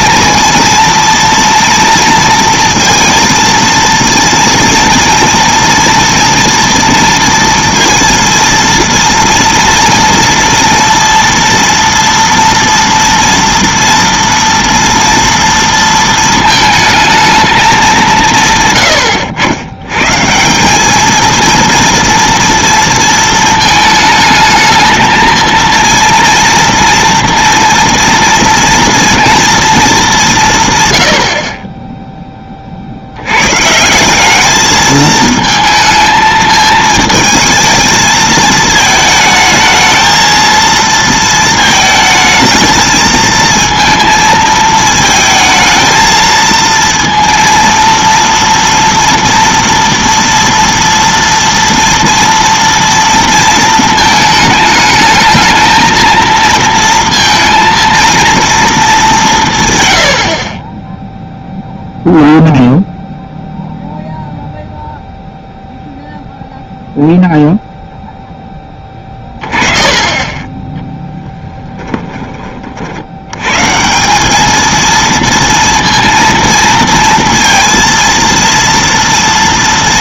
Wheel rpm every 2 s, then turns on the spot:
230, 230, 230, 230, 230, 230, 230, 240, 220, 120, 200, 230, 220, 230, 230, 130, 50, 210, 220, 220, 230, 220, 220, 230, 230, 230, 230, 220, 230, 230, 40, 0, 0, 0, 10, 20, 40, 220, 230, 230.
none